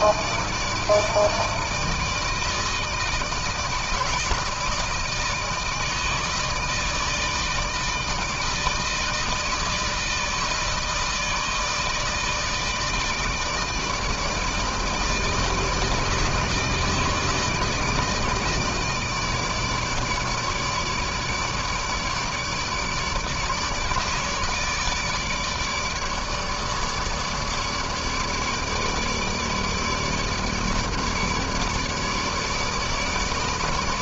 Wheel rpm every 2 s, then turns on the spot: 160, 160, 160, 160, 160, 160, 160, 160, 160, 160, 150, 150, 150, 150, 150, 160, 150.
none